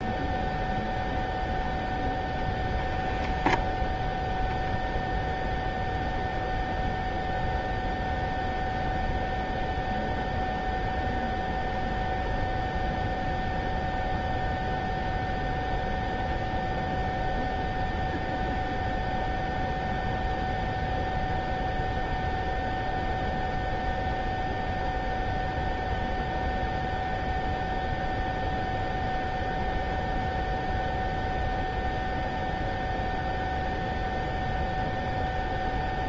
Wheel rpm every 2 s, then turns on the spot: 0, 0, 0, 0, 0, 0, 0, 0, 0, 0, 0, 0, 0, 0, 0, 0, 0, 0.
none